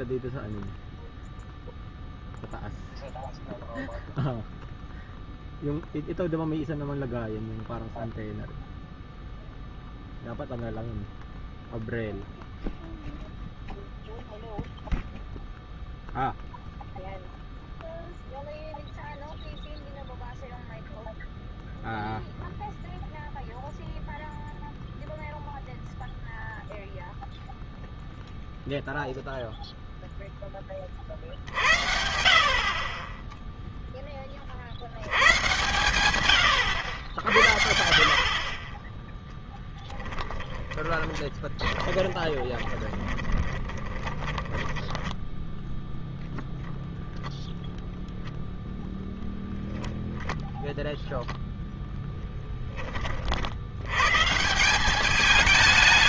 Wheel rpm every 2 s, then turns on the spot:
0, 0, 0, 0, 0, 0, 0, 0, 0, 0, 0, 0, 0, 0, 0, 20, 40, 70, 110, 30, 20, 20, 20, 0, 0, 10, 30, 160.
40-46